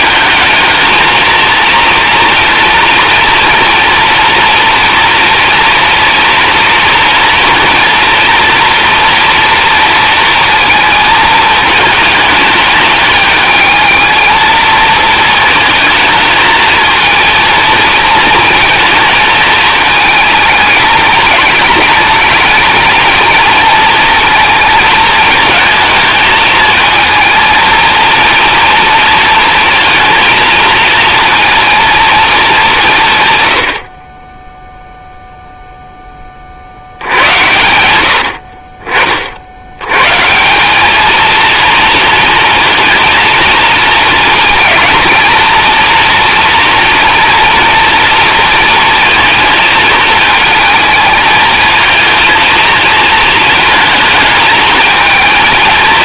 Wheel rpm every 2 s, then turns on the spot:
210, 230, 230, 230, 230, 220, 210, 230, 220, 230, 220, 220, 220, 220, 230, 230, 180, 0, 70, 50, 200, 230, 220, 230, 230, 220, 230, 220.
none